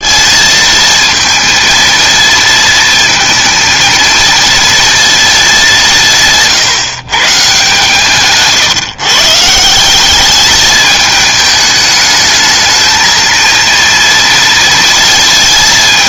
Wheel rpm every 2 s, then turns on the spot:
220, 230, 230, 140, 150, 220, 220, 230.
none